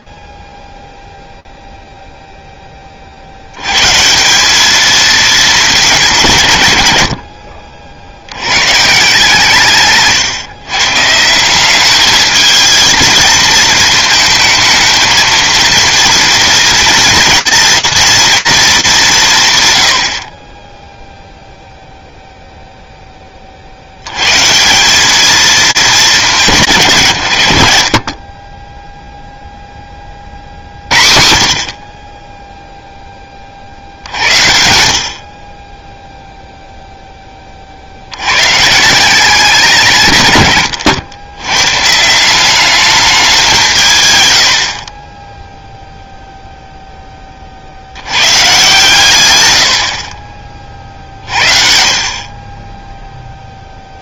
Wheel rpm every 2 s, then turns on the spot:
40, 10, 200, 140, 120, 130, 220, 220, 230, 210, 20, 10, 200, 120, 0, 70, 20, 40, 10, 170, 110, 200, 20, 20, 130, 50, 10.
none